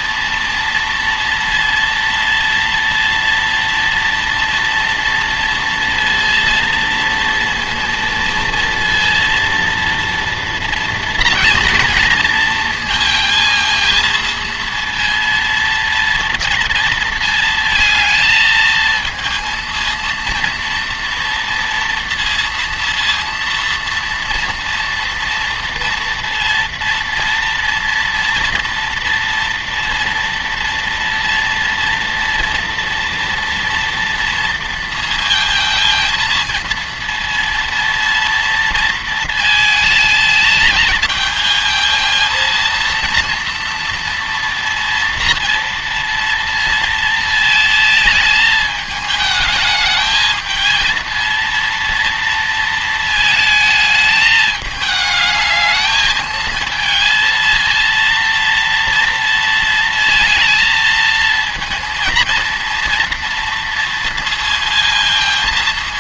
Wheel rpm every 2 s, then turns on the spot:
230, 230, 230, 230, 230, 230, 230, 230, 230, 220, 230, 230, 230, 230, 230, 230, 230, 230, 230, 230, 220, 230, 230, 230, 220, 220, 230, 220, 220, 230, 230, 230, 230.
none